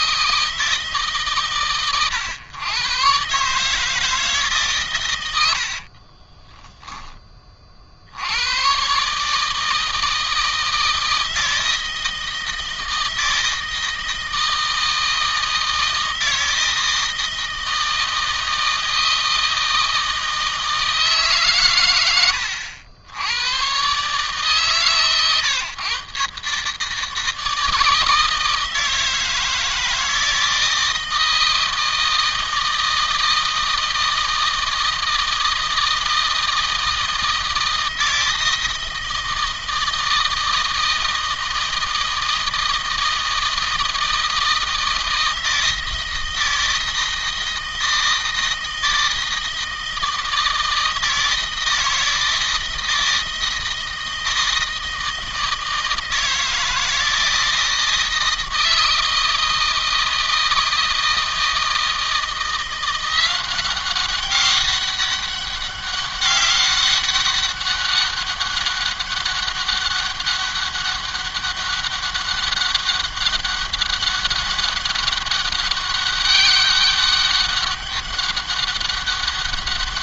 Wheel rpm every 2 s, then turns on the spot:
150, 120, 120, 20, 130, 160, 160, 160, 160, 160, 160, 80, 140, 150, 160, 160, 160, 160, 160, 160, 160, 160, 160, 160, 160, 160, 160, 160, 160, 160, 160, 170, 200, 200, 200, 200, 200, 200, 200, 200.
none